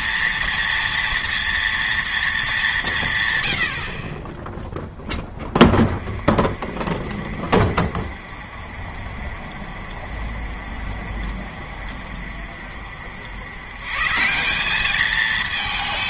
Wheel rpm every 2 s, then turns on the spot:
230, 170, 10, 40, 50, 50, 60, 200.
none